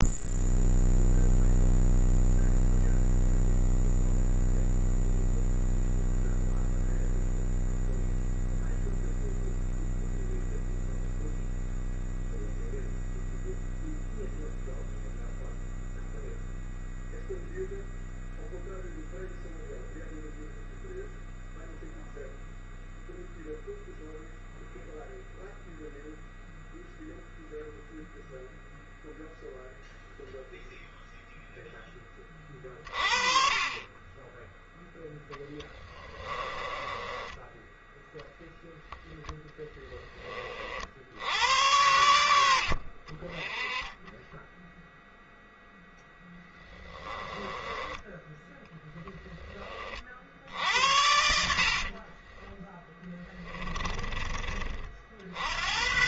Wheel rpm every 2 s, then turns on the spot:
0, 0, 0, 0, 0, 0, 0, 0, 0, 0, 0, 0, 0, 0, 0, 0, 40, 0, 20, 0, 60, 50, 0, 10, 0, 70, 10, 50.
36-38 42-44 52-54